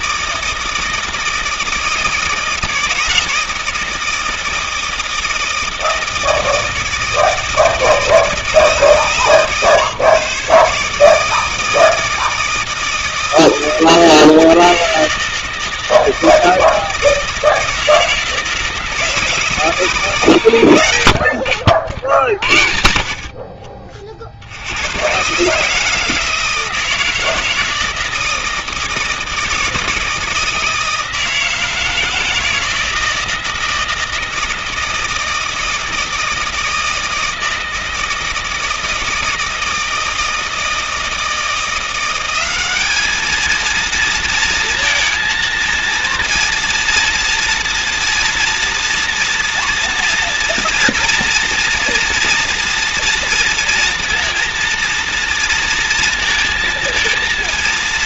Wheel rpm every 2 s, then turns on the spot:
160, 160, 160, 160, 160, 150, 160, 160, 160, 160, 120, 60, 80, 160, 160, 160, 160, 160, 160, 160, 160, 190, 230, 230, 230, 230, 230, 230, 220.
none